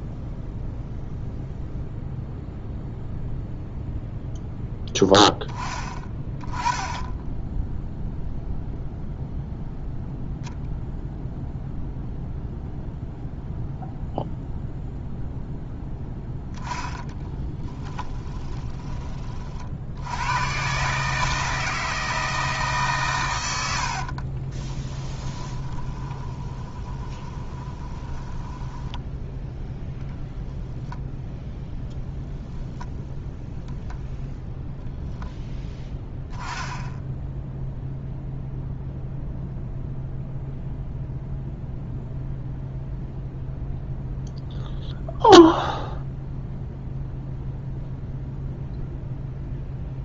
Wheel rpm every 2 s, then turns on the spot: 0, 0, 10, 10, 0, 0, 0, 0, 10, 20, 140, 140, 10, 20, 10, 0, 0, 0, 10, 0, 0, 0, 0, 0, 0.
16-18 24-30